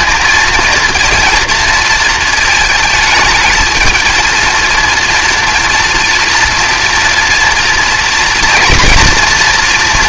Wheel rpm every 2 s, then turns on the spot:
230, 220, 230, 230, 240.
none